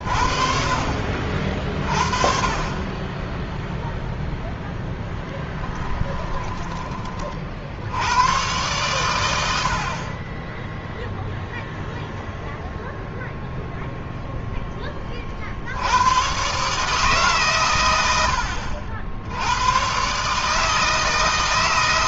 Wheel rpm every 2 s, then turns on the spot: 50, 20, 10, 30, 110, 0, 0, 20, 150, 70, 160.
4-6